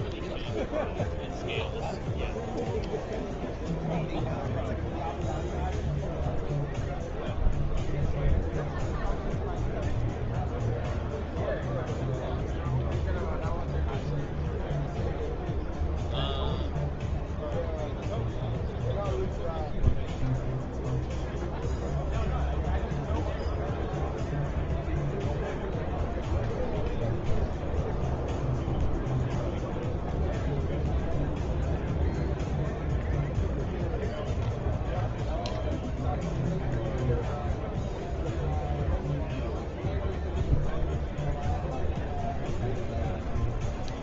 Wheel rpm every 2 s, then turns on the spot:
0, 0, 0, 0, 0, 0, 0, 0, 0, 0, 0, 0, 0, 0, 0, 0, 0, 0, 0, 0, 0, 0.
none